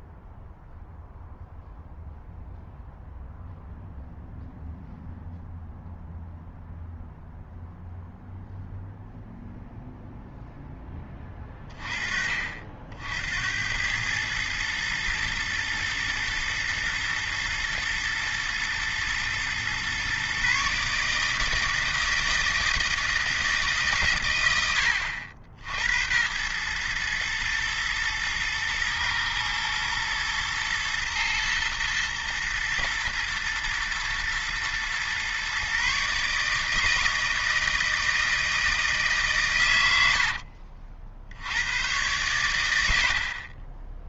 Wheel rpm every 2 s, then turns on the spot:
0, 0, 0, 0, 0, 10, 60, 110, 120, 120, 140, 160, 90, 110, 110, 110, 120, 120, 160, 160, 60, 80.
none